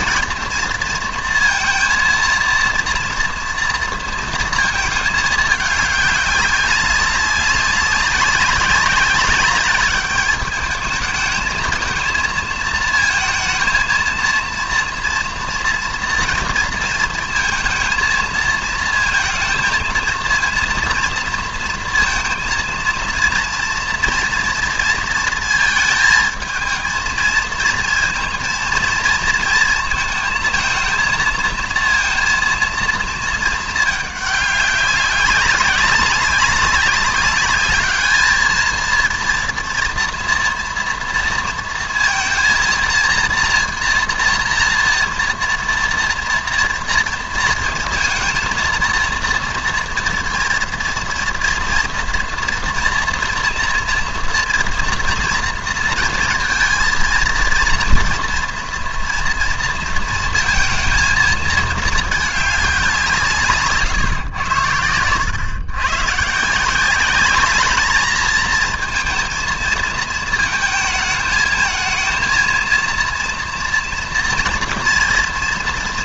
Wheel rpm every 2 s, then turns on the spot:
230, 230, 230, 200, 190, 210, 230, 230, 230, 220, 230, 230, 230, 220, 230, 220, 230, 200, 190, 220, 230, 230, 230, 240, 230, 230, 230, 230, 230, 230, 230, 200, 100, 170, 220, 220, 230, 230.
none